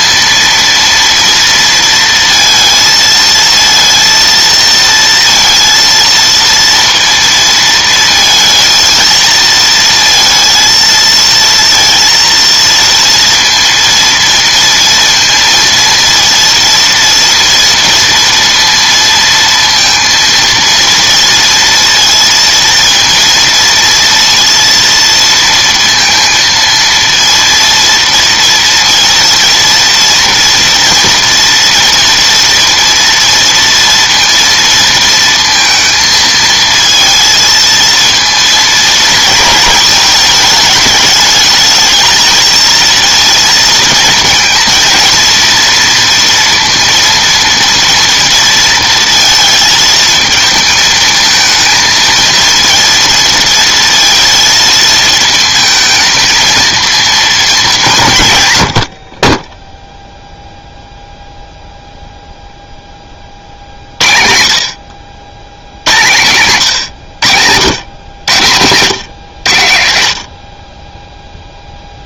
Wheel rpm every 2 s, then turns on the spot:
230, 230, 230, 230, 230, 230, 230, 230, 230, 230, 230, 230, 230, 230, 230, 230, 230, 230, 220, 230, 210, 230, 230, 230, 230, 220, 230, 230, 230, 100, 0, 0, 60, 130, 120, 40.
none